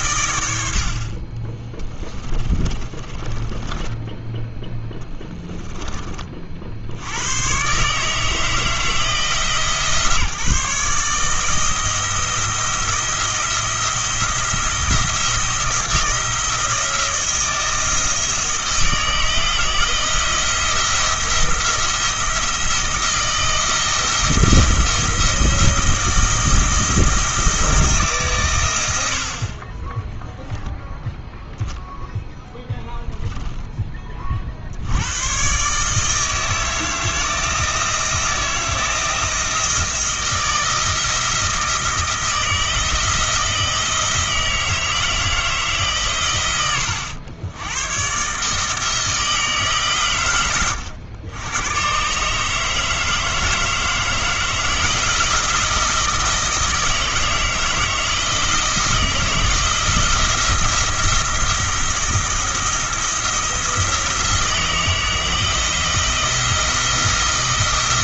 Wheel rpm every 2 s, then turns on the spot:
80, 40, 10, 60, 160, 150, 170, 170, 170, 160, 170, 160, 160, 170, 120, 0, 0, 50, 160, 170, 160, 170, 160, 110, 160, 80, 150, 160, 160, 170, 170, 170, 160, 170.
2-4